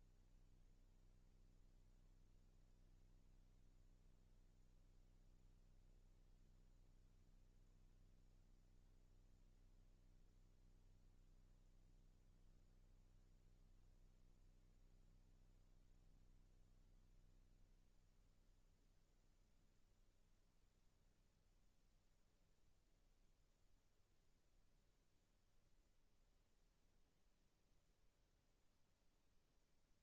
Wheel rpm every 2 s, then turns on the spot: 0, 0, 0, 0, 0, 0, 0, 0, 0, 0, 0, 0, 0, 0, 0.
none